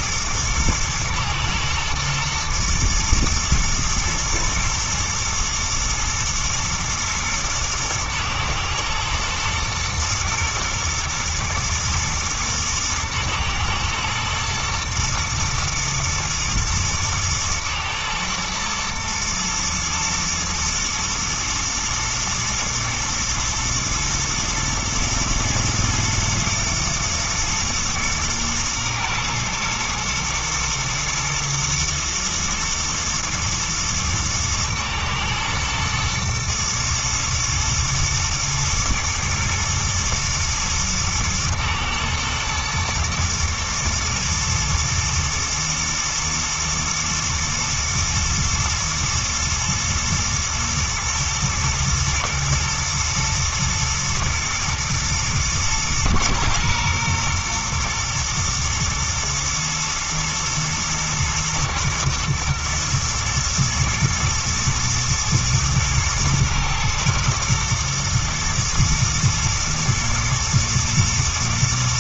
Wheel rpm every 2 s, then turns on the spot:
110, 120, 120, 120, 110, 120, 110, 110, 120, 110, 110, 110, 110, 110, 120, 120, 110, 110, 120, 110, 110, 110, 120, 110, 120, 110, 110, 110, 120, 110, 120, 120, 110, 110, 110, 120.
none